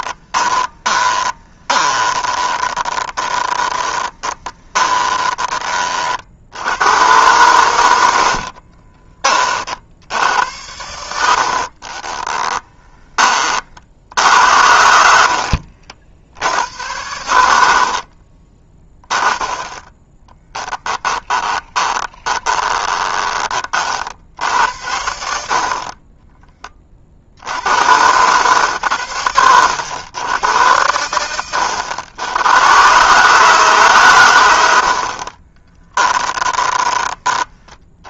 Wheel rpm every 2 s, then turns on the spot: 20, 20, 20, 100, 40, 80, 20, 70, 90, 20, 10, 30, 80, 30, 110, 100, 120, 80, 20.
0-6 8-10 14-16 20-24 36-38